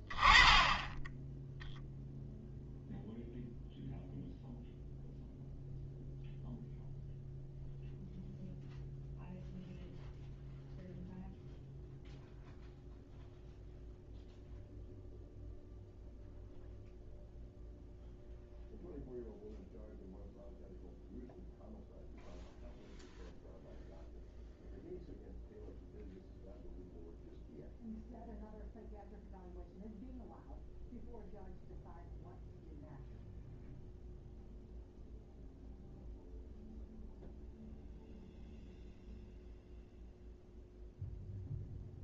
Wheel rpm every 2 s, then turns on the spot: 10, 0, 0, 0, 0, 0, 0, 0, 0, 0, 0, 0, 0, 0, 0, 0, 0, 0, 0, 0, 0.
none